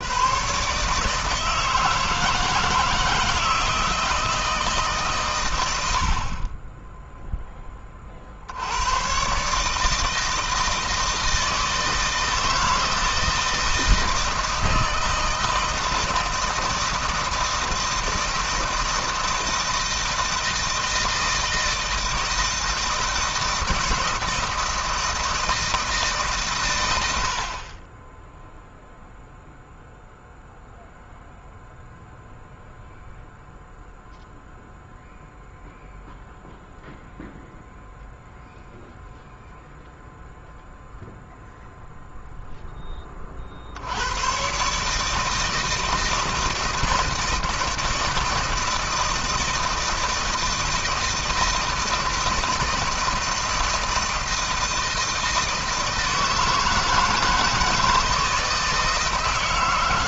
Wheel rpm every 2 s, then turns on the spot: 150, 160, 140, 10, 100, 160, 160, 160, 160, 160, 160, 160, 170, 100, 0, 0, 0, 0, 0, 0, 0, 20, 150, 160, 160, 160, 160, 160, 160, 160.
none